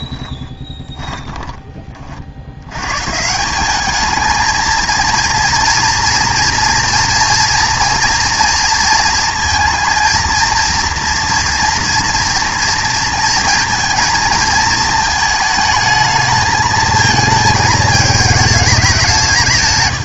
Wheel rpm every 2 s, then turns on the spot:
30, 100, 220, 230, 230, 230, 230, 220, 220, 210.
0-2